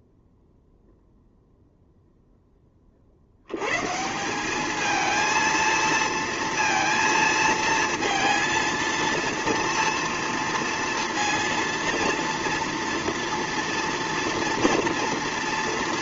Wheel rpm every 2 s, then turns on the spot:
0, 20, 210, 230, 230, 230, 230, 230.
none